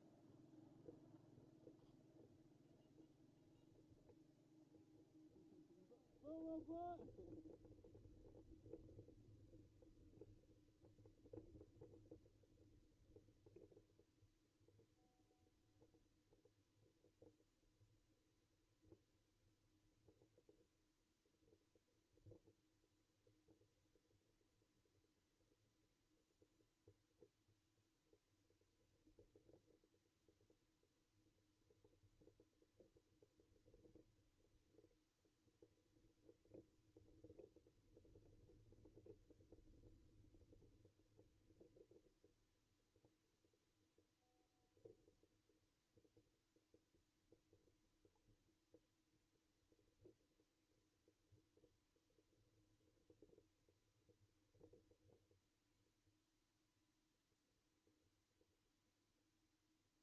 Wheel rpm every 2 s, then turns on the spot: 0, 0, 0, 0, 0, 0, 0, 0, 0, 0, 0, 0, 0, 0, 0, 0, 0, 0, 0, 0, 0, 0, 0, 0, 0, 0, 0, 0, 0, 0.
none